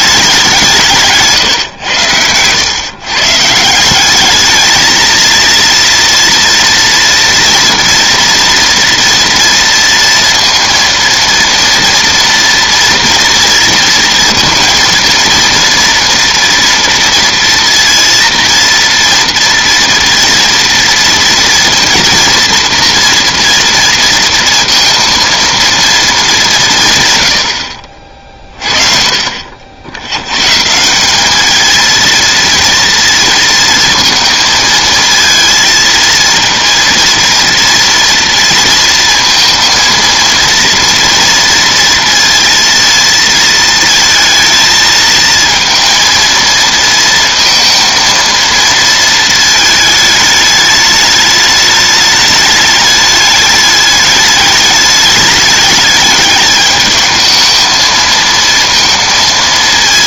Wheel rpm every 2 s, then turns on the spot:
180, 110, 210, 230, 230, 230, 230, 230, 230, 230, 230, 230, 230, 170, 30, 160, 230, 230, 230, 230, 230, 230, 220, 230, 230, 210, 210, 210, 210, 230.
none